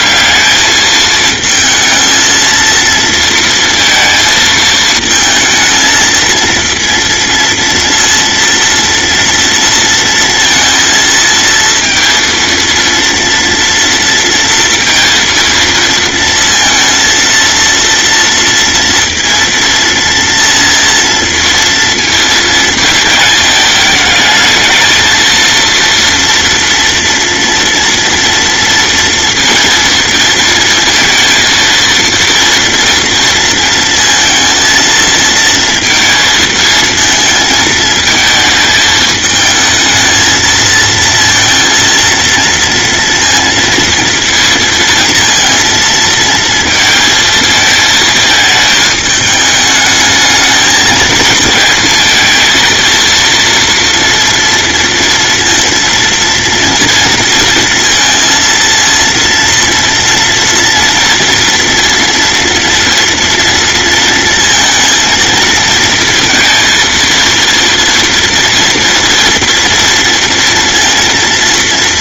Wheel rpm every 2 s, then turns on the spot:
210, 230, 220, 230, 230, 230, 230, 230, 230, 230, 230, 220, 220, 230, 230, 230, 230, 230, 220, 220, 230, 230, 230, 230, 210, 220, 230, 230, 230, 230, 230, 230, 230, 230, 230, 230.
none